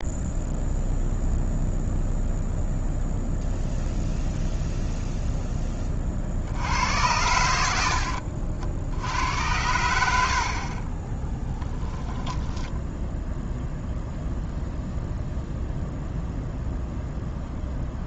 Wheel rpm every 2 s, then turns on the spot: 0, 0, 0, 50, 60, 70, 10, 0, 0.
12-14